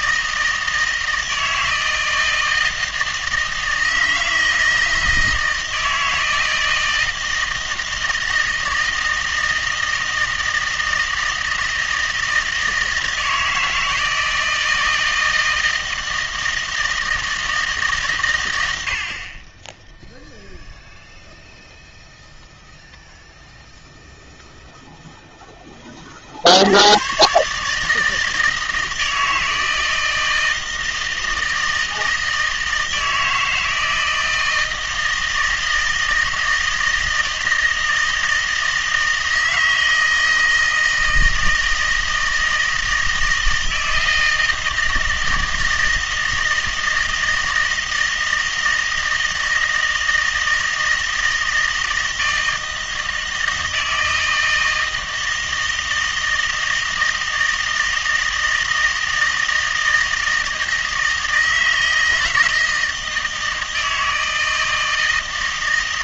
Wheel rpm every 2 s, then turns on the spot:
160, 160, 160, 160, 160, 160, 160, 160, 160, 90, 0, 0, 0, 90, 160, 160, 160, 160, 160, 160, 160, 160, 160, 160, 160, 160, 160, 160, 160, 160, 160, 160, 160.
none